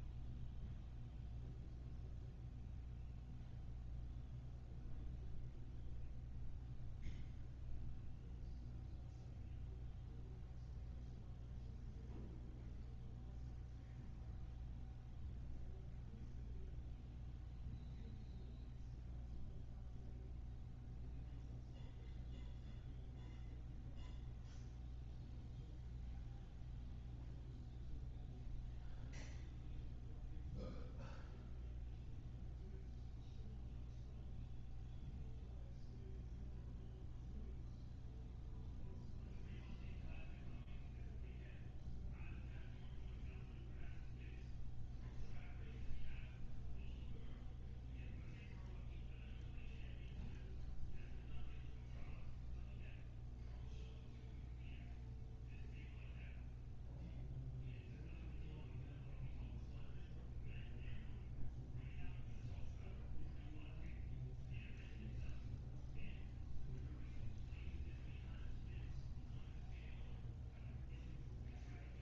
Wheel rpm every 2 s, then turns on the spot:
0, 0, 0, 0, 0, 0, 0, 0, 0, 0, 0, 0, 0, 0, 0, 0, 0, 0, 0, 0, 0, 0, 0, 0, 0, 0, 0, 0, 0, 0, 0, 0, 0, 0, 0, 0.
none